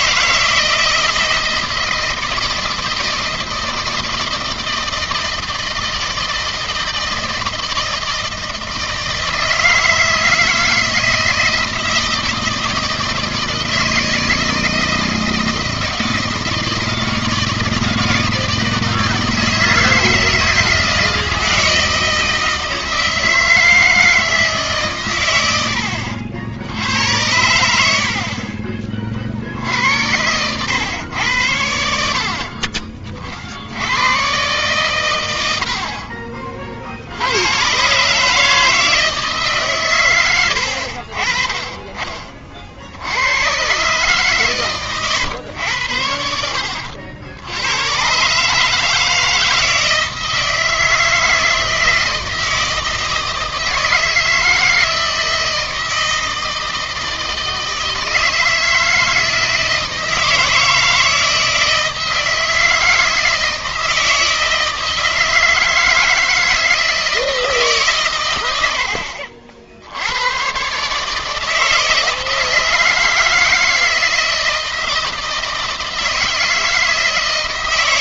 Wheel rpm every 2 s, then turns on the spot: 160, 160, 160, 160, 160, 160, 160, 160, 160, 160, 160, 160, 150, 80, 30, 100, 50, 130, 40, 160, 90, 50, 130, 80, 150, 160, 160, 160, 160, 160, 160, 160, 160, 160, 90, 130, 160, 160, 160.
32-34 40-42